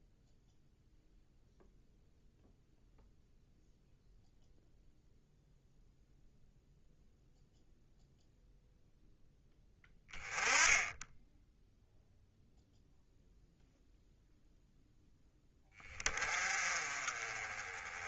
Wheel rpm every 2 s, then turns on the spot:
0, 0, 0, 0, 0, 10, 0, 0, 30.
none